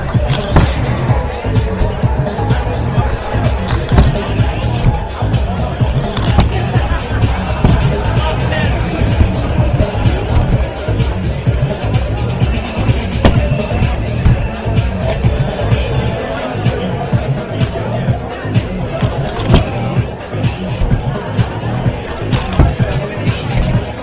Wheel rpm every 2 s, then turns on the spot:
0, 0, 0, 0, 0, 0, 0, 0, 0, 0, 0, 0.
none